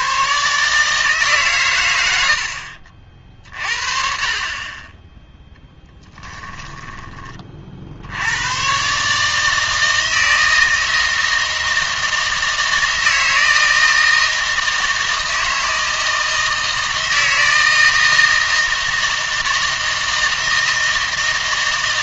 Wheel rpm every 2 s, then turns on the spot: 150, 60, 20, 10, 120, 160, 160, 160, 160, 160, 160.
6-8